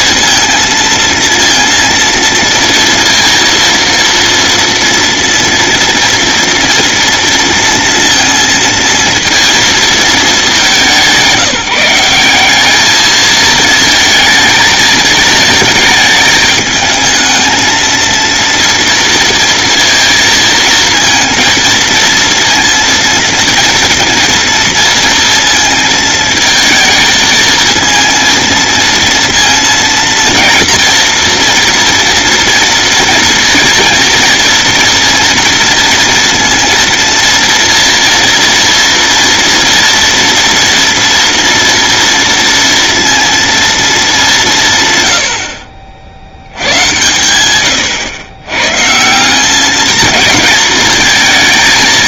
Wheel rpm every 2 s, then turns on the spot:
230, 230, 230, 230, 230, 180, 220, 220, 220, 230, 230, 230, 230, 220, 230, 230, 230, 230, 230, 230, 230, 230, 120, 110, 140, 220.
none